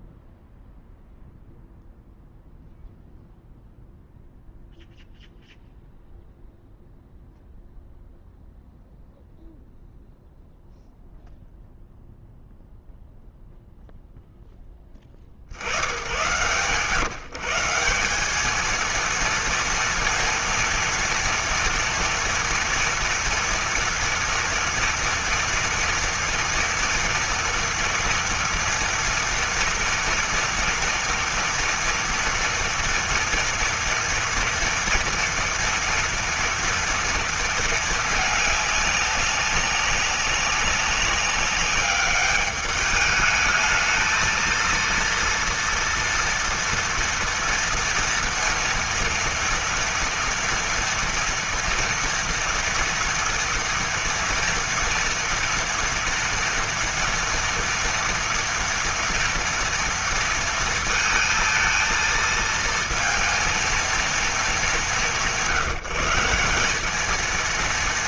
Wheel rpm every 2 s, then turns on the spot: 0, 0, 0, 0, 0, 0, 0, 10, 120, 220, 230, 230, 230, 230, 230, 230, 230, 230, 230, 210, 190, 210, 220, 230, 230, 230, 230, 230, 230, 230, 230, 230, 190, 190.
none